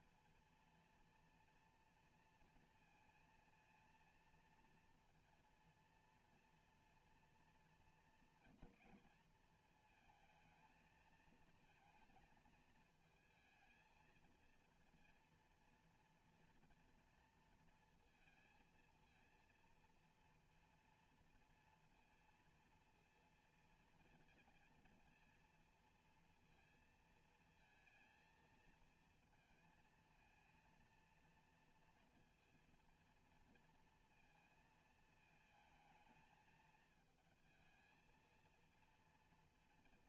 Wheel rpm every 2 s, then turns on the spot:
230, 230, 230, 240, 240, 220, 220, 230, 230, 220, 230, 230, 230, 230, 230, 230, 230, 230, 220, 230.
none